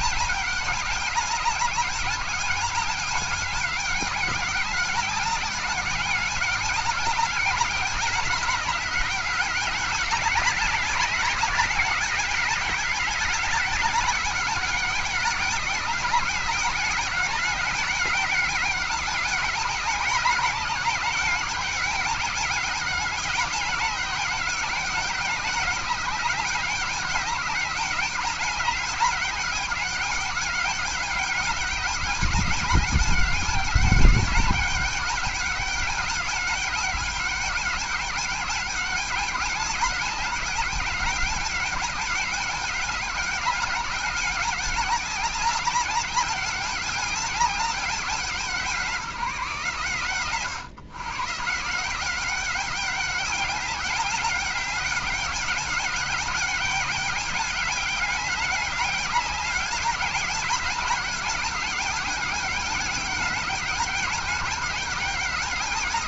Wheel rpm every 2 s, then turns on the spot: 200, 200, 200, 190, 200, 200, 200, 200, 190, 190, 190, 200, 190, 190, 200, 200, 200, 200, 200, 190, 190, 200, 200, 200, 200, 130, 200, 200, 190, 200, 200, 200, 200.
none